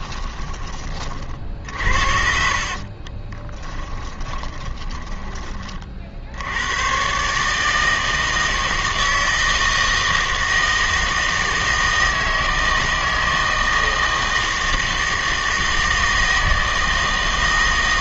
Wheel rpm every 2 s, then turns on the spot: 20, 40, 20, 90, 160, 160, 160, 160, 160.
2-6